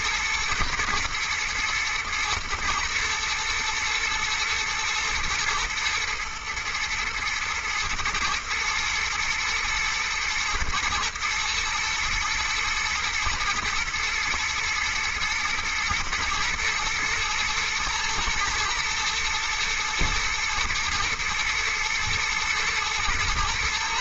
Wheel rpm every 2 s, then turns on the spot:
110, 110, 110, 120, 110, 110, 110, 110, 120, 110, 110, 110.
none